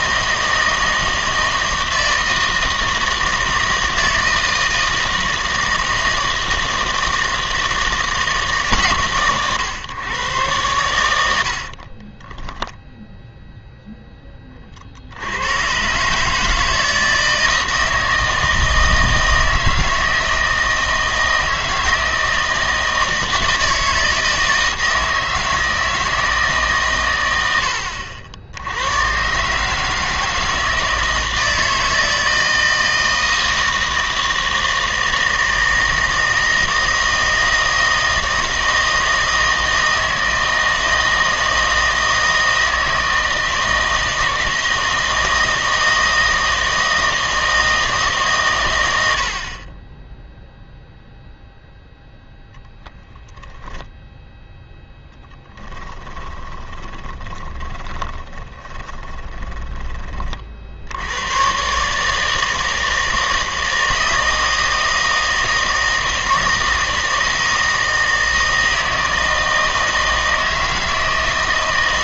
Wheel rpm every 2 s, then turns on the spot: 160, 160, 160, 160, 140, 110, 0, 40, 160, 160, 160, 160, 160, 130, 90, 160, 160, 160, 160, 160, 160, 160, 160, 160, 110, 0, 0, 0, 20, 20, 70, 160, 160, 160, 160, 160.
56-60